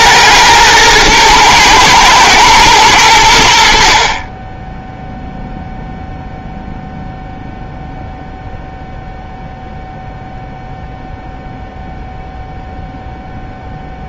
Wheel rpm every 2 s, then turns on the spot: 110, 100, 0, 0, 0, 0, 0.
none